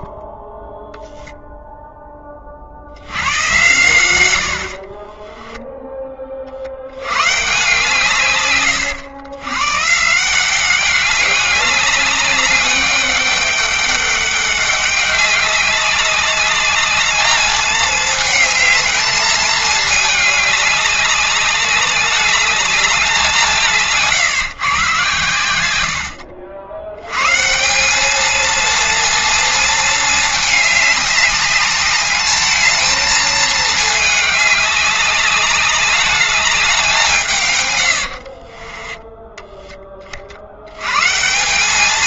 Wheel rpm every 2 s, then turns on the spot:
0, 70, 30, 100, 110, 200, 200, 200, 210, 220, 200, 200, 130, 100, 230, 200, 220, 200, 170, 10, 130.
4-6 38-40